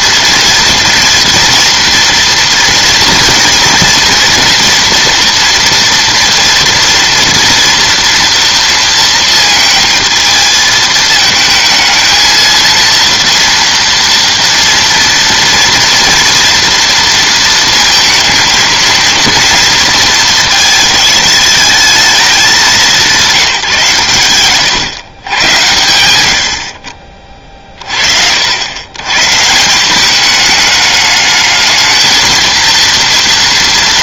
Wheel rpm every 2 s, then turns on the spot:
230, 230, 230, 230, 230, 220, 230, 230, 230, 230, 220, 190, 130, 60, 110, 210, 230.
none